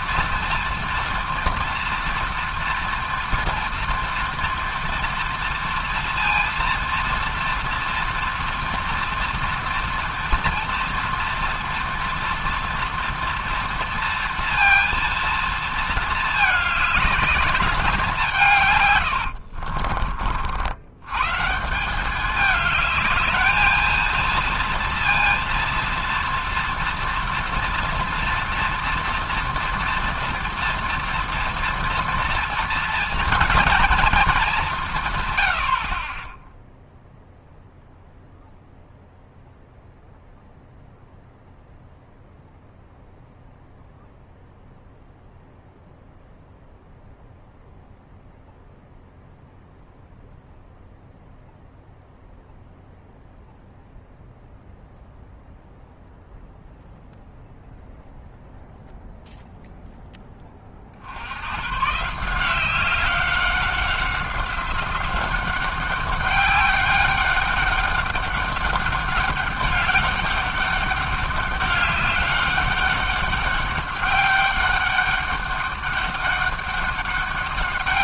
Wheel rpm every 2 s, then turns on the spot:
240, 230, 230, 230, 230, 230, 230, 230, 220, 140, 70, 210, 230, 240, 240, 230, 230, 200, 0, 0, 0, 0, 0, 0, 0, 0, 0, 0, 0, 0, 20, 180, 190, 200, 200, 200, 200, 200, 200.
none